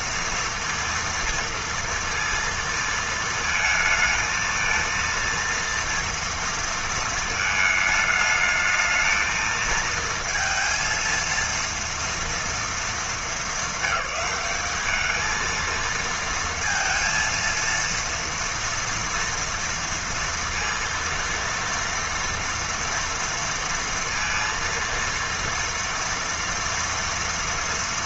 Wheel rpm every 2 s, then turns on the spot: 230, 230, 230, 230, 220, 230, 210, 220, 230, 230, 230, 230, 230, 230.
none